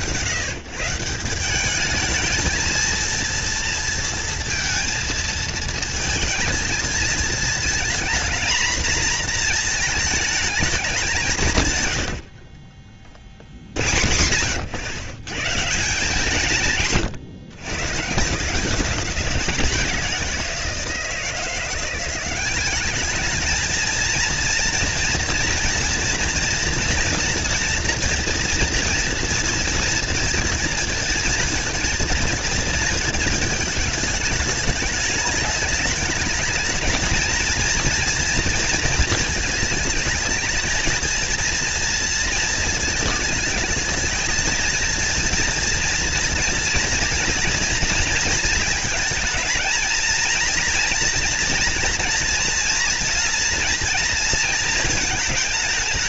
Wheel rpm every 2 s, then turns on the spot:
130, 220, 230, 220, 230, 200, 30, 120, 160, 180, 170, 200, 240, 240, 230, 230, 230, 210, 220, 230, 220, 220, 230, 240, 220, 230, 230, 220.
none